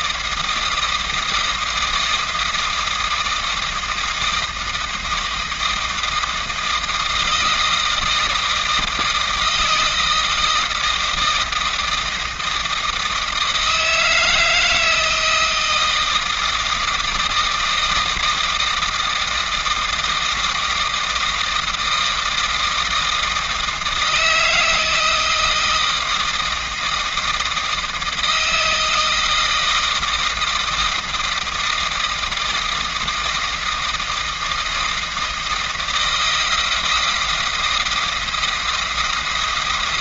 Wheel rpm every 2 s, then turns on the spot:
160, 160, 160, 160, 160, 160, 160, 160, 160, 160, 160, 160, 160, 160, 160, 160, 160, 160, 170, 170.
none